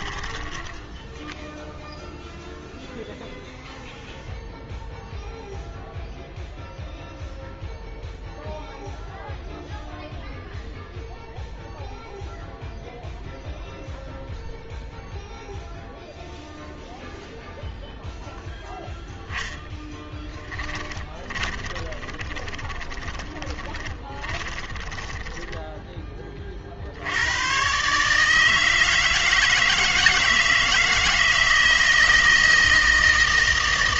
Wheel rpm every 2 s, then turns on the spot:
10, 0, 0, 0, 0, 0, 0, 0, 0, 0, 20, 20, 20, 70, 160, 170, 160.
0-2 20-26